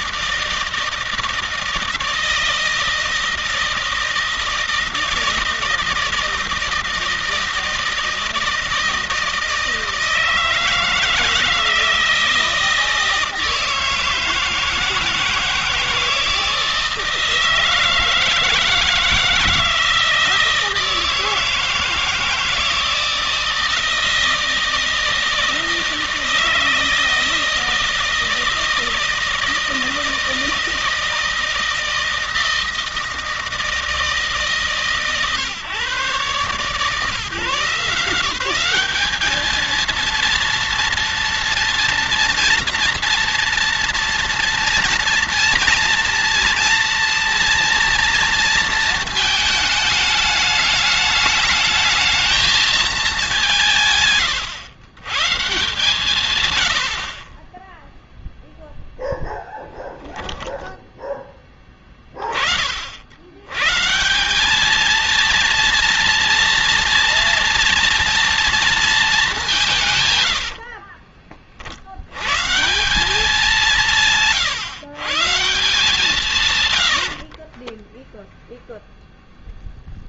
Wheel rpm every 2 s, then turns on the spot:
160, 160, 160, 160, 160, 160, 160, 160, 160, 160, 160, 160, 160, 160, 160, 160, 160, 140, 150, 200, 230, 230, 230, 230, 230, 210, 210, 130, 60, 0, 10, 50, 210, 240, 220, 40, 190, 140, 90, 0.
70-72 76-78